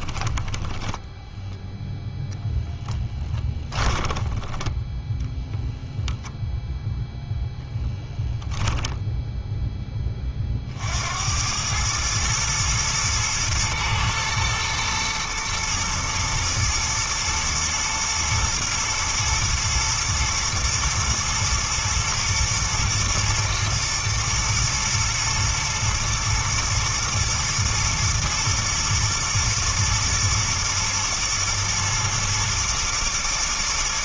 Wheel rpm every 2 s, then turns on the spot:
10, 0, 10, 0, 10, 60, 110, 120, 120, 110, 110, 120, 120, 120, 120, 120, 120.
0-2 4-6 8-10